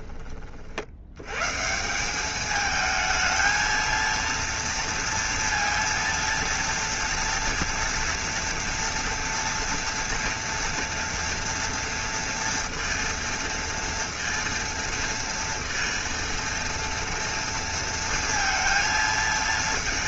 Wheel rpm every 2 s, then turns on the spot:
40, 210, 230, 230, 230, 230, 230, 230, 230, 230.
none